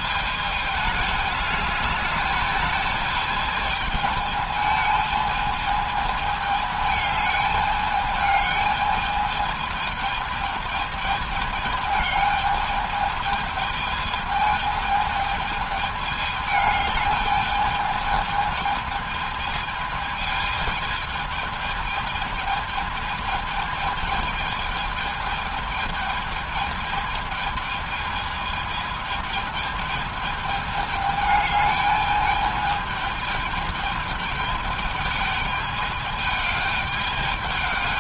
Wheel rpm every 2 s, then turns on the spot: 210, 220, 210, 210, 210, 220, 210, 220, 210, 220, 220, 220, 210, 220, 220, 210, 210, 210, 210.
none